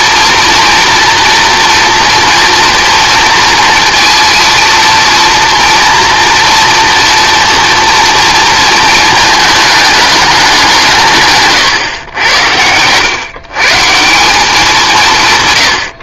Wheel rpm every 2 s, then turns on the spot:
230, 230, 230, 230, 230, 180, 110, 170.
none